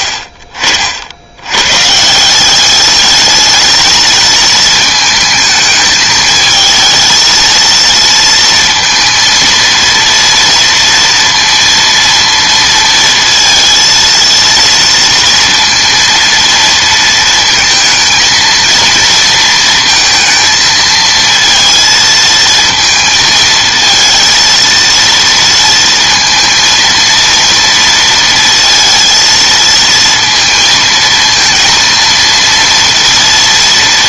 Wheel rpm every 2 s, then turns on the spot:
50, 200, 220, 220, 230, 230, 230, 230, 230, 230, 220, 230, 230, 230, 230, 230, 230.
none